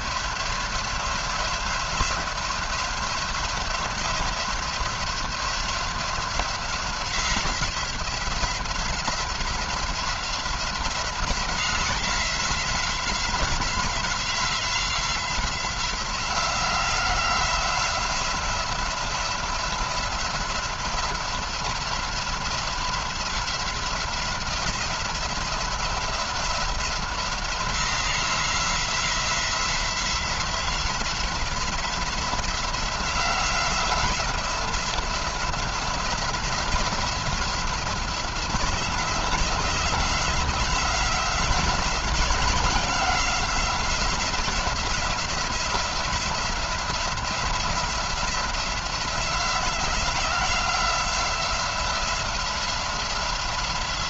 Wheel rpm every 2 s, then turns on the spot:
180, 180, 180, 180, 180, 180, 180, 180, 180, 180, 180, 180, 180, 170, 180, 180, 180, 170, 180, 180, 180, 180, 180, 180, 170, 180, 180.
none